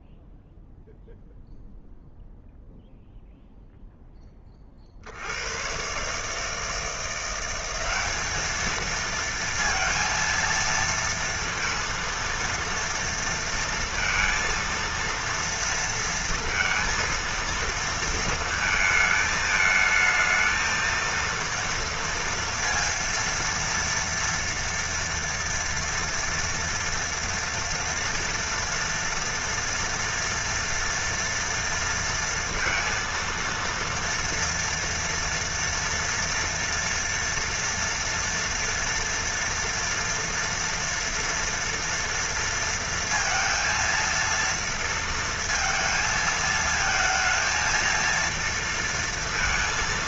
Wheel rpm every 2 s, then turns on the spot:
0, 0, 10, 150, 210, 230, 230, 230, 230, 220, 220, 230, 230, 230, 230, 230, 230, 230, 230, 240, 230, 230, 230, 230, 230.
none